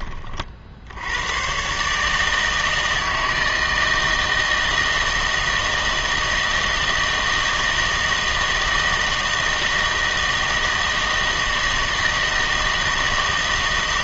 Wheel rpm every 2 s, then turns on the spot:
60, 160, 160, 160, 160, 160, 160.
none